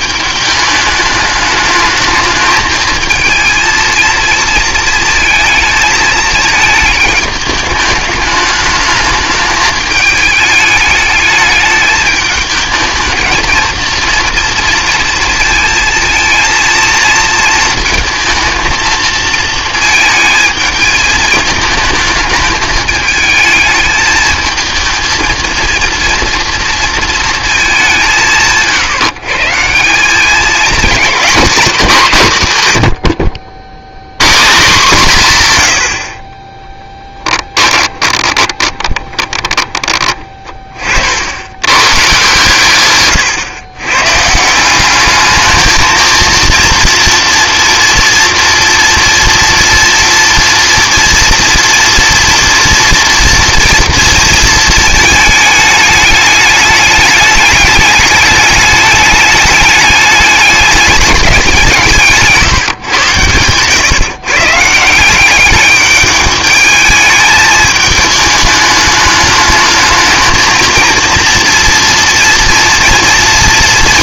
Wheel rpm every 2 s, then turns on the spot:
210, 220, 220, 220, 210, 210, 220, 230, 230, 220, 220, 220, 220, 230, 130, 210, 130, 160, 10, 20, 30, 120, 180, 230, 230, 230, 240, 230, 210, 210, 200, 140, 160, 210, 210, 220, 230.
38-40